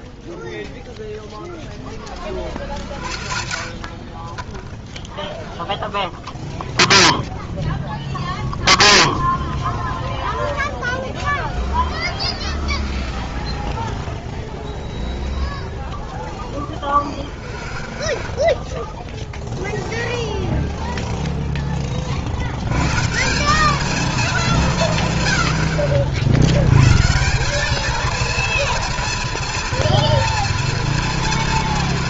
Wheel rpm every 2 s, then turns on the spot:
20, 20, 0, 0, 0, 0, 0, 0, 0, 0, 20, 220, 70, 220, 240, 230.
2-4